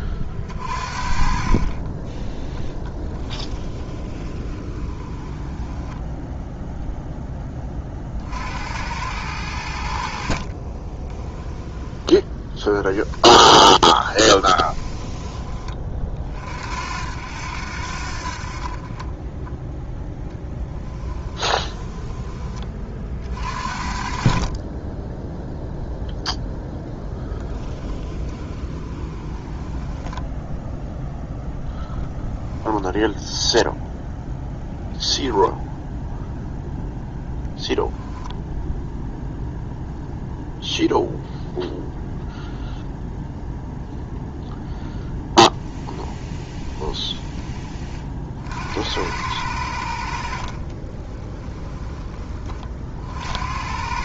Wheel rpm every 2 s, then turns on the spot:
40, 10, 20, 0, 90, 20, 10, 20, 60, 30, 10, 40, 20, 10, 20, 0, 0, 10, 0, 0, 0, 0, 0, 0, 80, 20, 60.
2-6 10-12 14-16 20-22 28-30 34-36 50-52